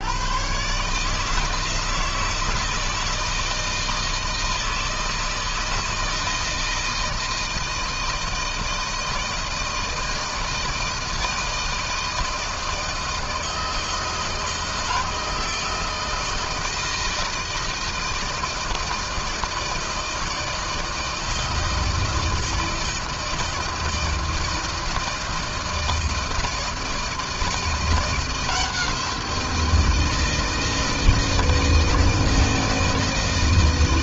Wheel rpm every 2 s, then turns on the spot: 130, 170, 160, 160, 160, 160, 160, 160, 160, 160, 160, 160, 160, 160, 170, 160, 160.
none